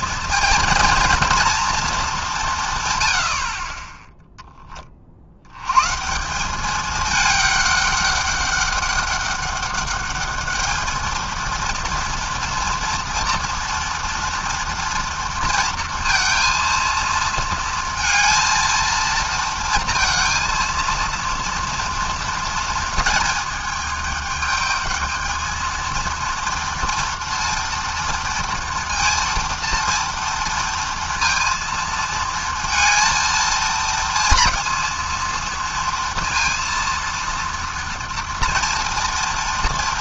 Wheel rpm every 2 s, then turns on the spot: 230, 80, 80, 210, 200, 220, 230, 230, 220, 230, 230, 220, 220, 230, 230, 230, 230, 230, 230, 230.
none